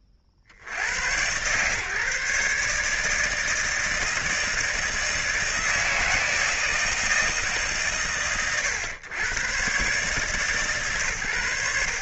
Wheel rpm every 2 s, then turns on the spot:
50, 150, 160, 160, 100, 150.
none